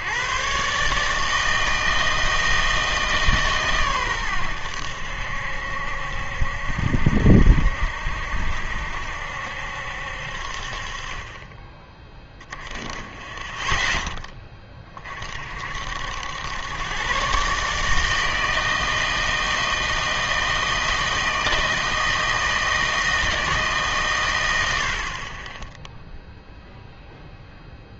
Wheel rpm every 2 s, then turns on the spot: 150, 160, 80, 70, 70, 40, 20, 30, 120, 160, 160, 160, 60, 0.
none